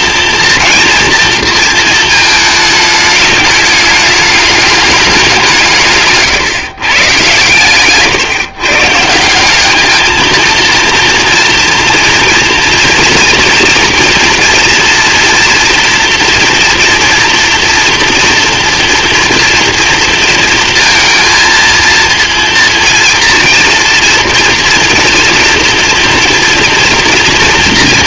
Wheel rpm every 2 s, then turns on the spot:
230, 220, 210, 120, 150, 230, 230, 230, 240, 230, 230, 230, 230, 240.
none